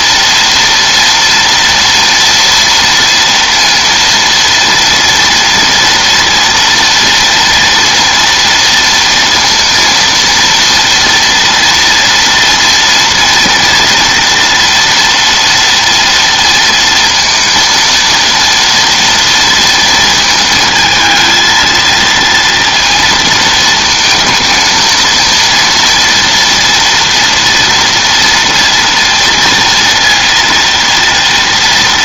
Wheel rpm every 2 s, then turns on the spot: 240, 230, 230, 230, 230, 230, 240, 230, 230, 230, 230, 230, 230, 230, 230, 230.
none